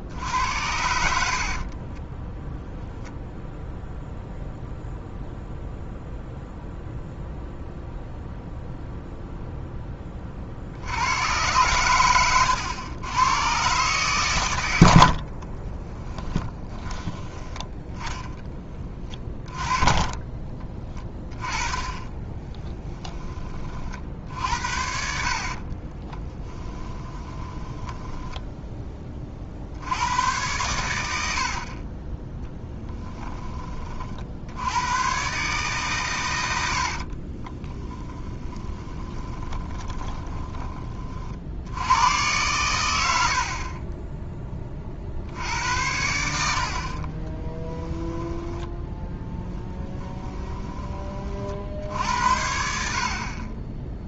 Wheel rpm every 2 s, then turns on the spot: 70, 0, 0, 0, 0, 80, 110, 70, 10, 30, 20, 20, 70, 10, 10, 100, 10, 90, 70, 20, 30, 100, 40, 60, 10, 30, 60.
0-2 20-22 24-28 32-34 36-40 46-50